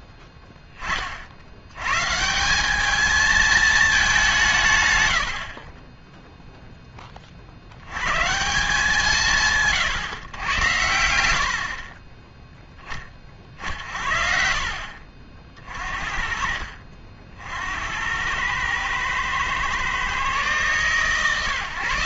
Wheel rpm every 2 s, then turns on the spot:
20, 200, 160, 0, 170, 100, 20, 50, 60, 110, 130.
none